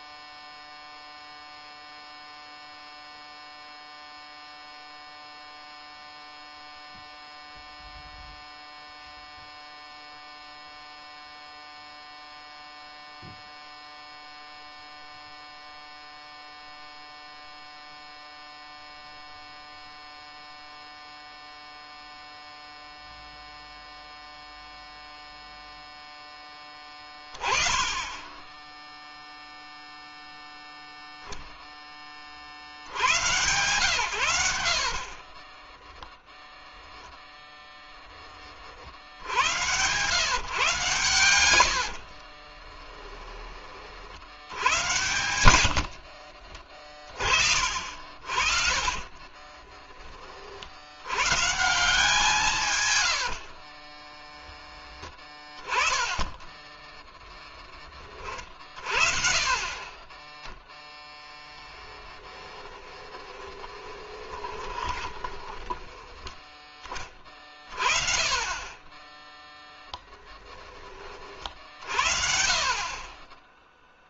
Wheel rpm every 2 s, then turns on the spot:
0, 0, 0, 0, 0, 0, 0, 0, 0, 0, 0, 0, 0, 10, 0, 0, 90, 50, 0, 60, 130, 20, 100, 40, 30, 90, 130, 10, 10, 50, 0, 10, 20, 20, 10, 30, 30.
34-36 42-50 52-54 56-58 62-66